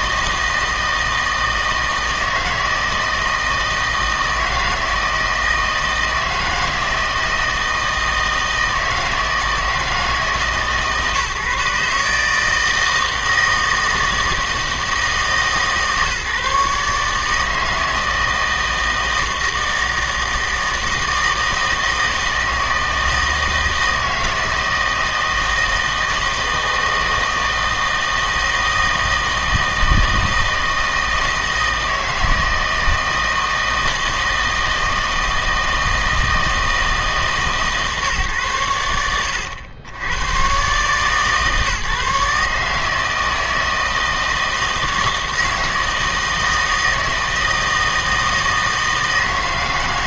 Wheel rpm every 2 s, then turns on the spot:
160, 160, 160, 160, 160, 150, 160, 160, 140, 160, 160, 160, 160, 160, 160, 160, 160, 160, 160, 100, 130, 150, 160, 160, 160.
none